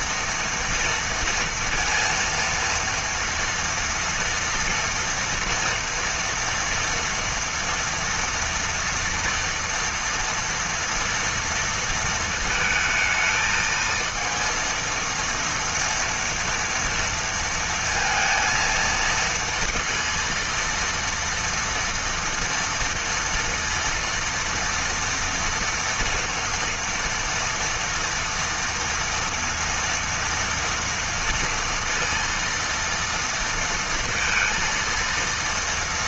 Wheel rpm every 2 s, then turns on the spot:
230, 230, 230, 230, 230, 230, 220, 230, 230, 230, 230, 230, 230, 230, 230, 230, 230, 230.
none